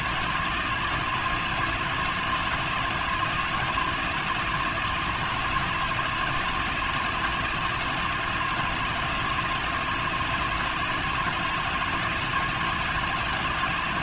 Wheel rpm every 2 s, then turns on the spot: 160, 170, 160, 160, 160, 170, 160.
none